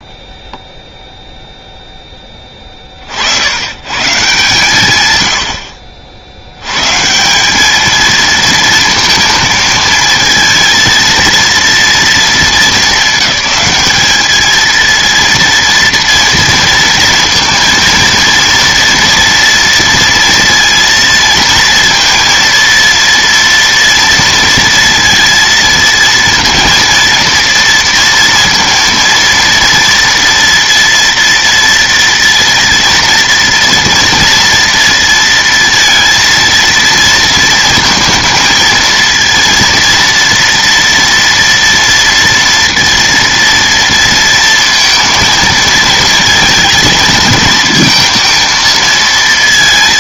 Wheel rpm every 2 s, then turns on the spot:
0, 30, 130, 100, 230, 230, 220, 220, 230, 230, 230, 230, 230, 230, 230, 230, 230, 230, 220, 220, 230, 230, 230, 230, 230.
none